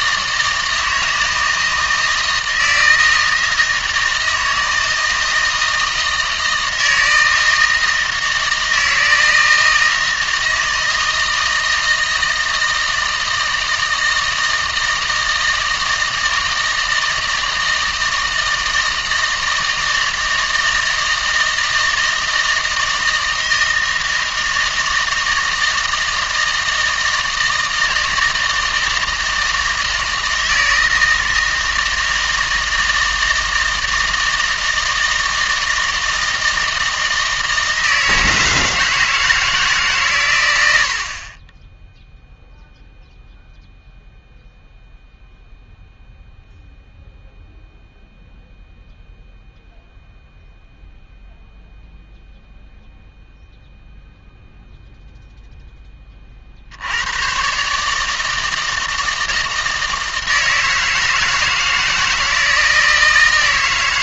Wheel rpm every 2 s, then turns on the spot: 160, 160, 160, 160, 160, 160, 160, 160, 160, 160, 160, 160, 160, 160, 160, 160, 160, 160, 160, 160, 70, 0, 0, 0, 0, 0, 0, 0, 90, 160, 160, 160.
none